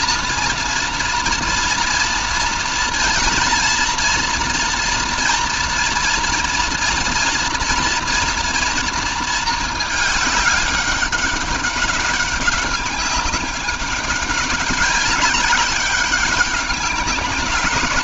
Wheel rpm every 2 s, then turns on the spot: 230, 230, 240, 230, 230, 200, 190, 200, 190.
none